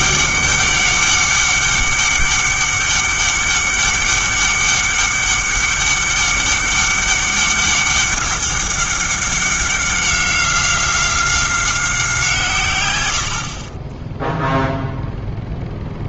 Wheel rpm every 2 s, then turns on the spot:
200, 200, 200, 200, 200, 190, 130, 0.
none